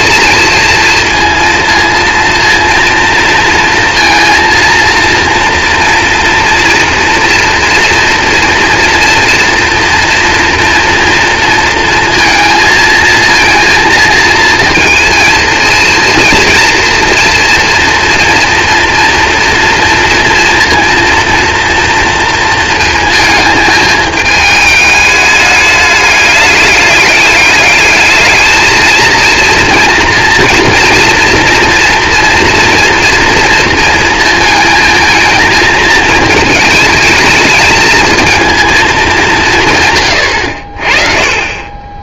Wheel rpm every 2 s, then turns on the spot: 230, 230, 230, 230, 230, 240, 220, 230, 230, 230, 230, 230, 210, 200, 220, 230, 230, 220, 220, 230, 70.
none